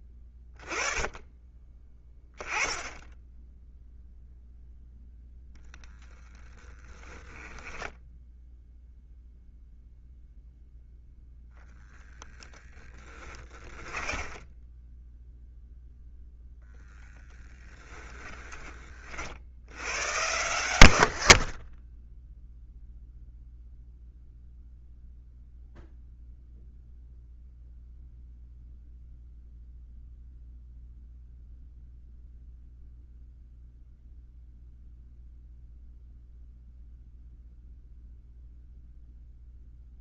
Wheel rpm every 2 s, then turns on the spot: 20, 10, 0, 20, 0, 0, 10, 10, 0, 40, 90, 0, 0, 0, 0, 0, 0, 0, 0, 0.
6-8 12-16